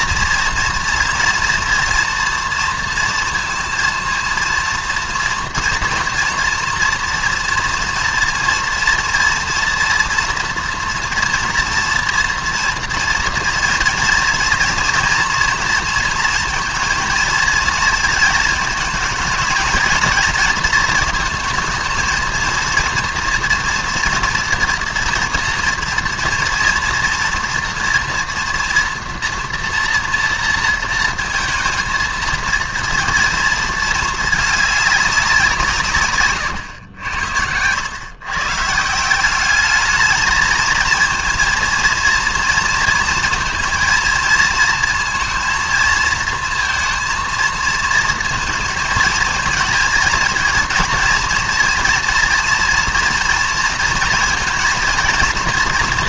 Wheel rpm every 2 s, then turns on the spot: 230, 230, 230, 230, 230, 230, 230, 230, 230, 220, 220, 230, 240, 230, 230, 230, 230, 220, 130, 110, 220, 230, 230, 230, 230, 230, 230, 230.
none